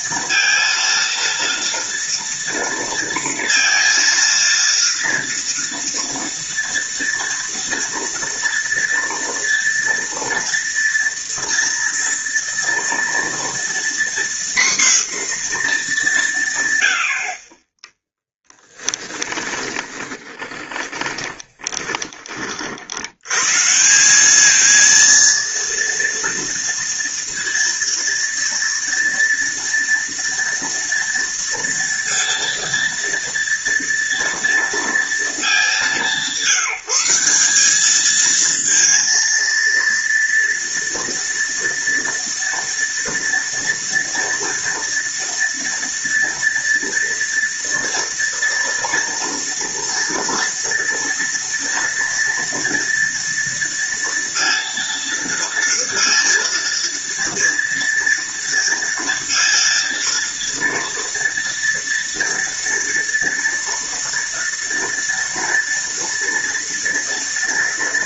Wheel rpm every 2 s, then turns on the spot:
230, 230, 230, 230, 230, 240, 230, 250, 100, 20, 20, 60, 220, 230, 230, 230, 230, 230, 190, 230, 230, 230, 230, 230, 230, 230, 230, 230, 230, 230, 230, 230, 230, 230.
18-22